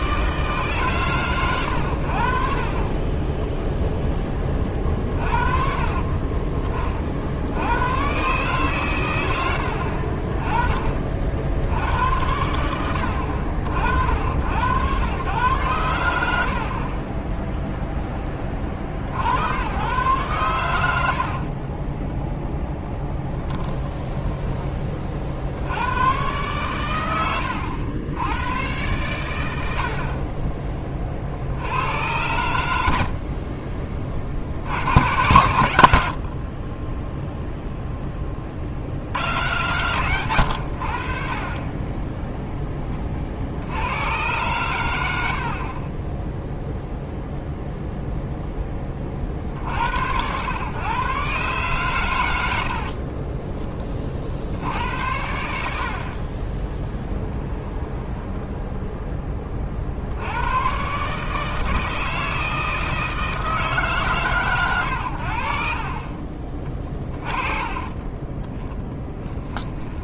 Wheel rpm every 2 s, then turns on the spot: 150, 50, 40, 30, 130, 30, 90, 100, 60, 50, 90, 10, 20, 120, 110, 20, 90, 70, 30, 50, 100, 10, 110, 0, 20, 120, 80, 70, 10, 10, 120, 160, 120, 30, 10.
2-4 16-18 66-70